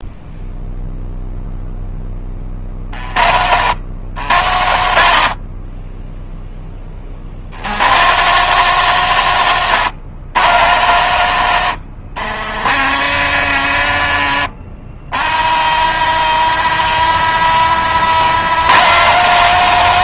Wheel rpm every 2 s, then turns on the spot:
0, 60, 90, 30, 160, 120, 70, 60, 90, 140.
12-18